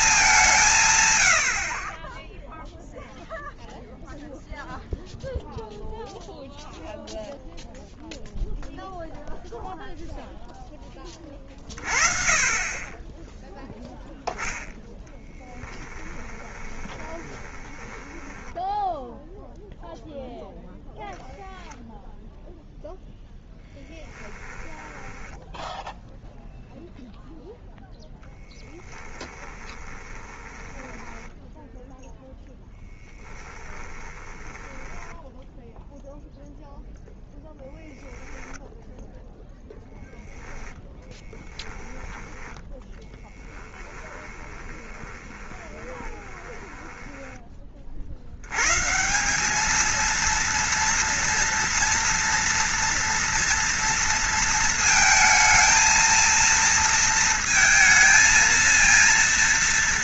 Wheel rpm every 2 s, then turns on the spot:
170, 0, 0, 0, 0, 10, 20, 10, 20, 10, 0, 10, 10, 0, 10, 10, 10, 10, 0, 0, 0, 10, 20, 20, 100, 230, 230, 220, 230, 230.
16-20 24-26 28-32 34-36 44-48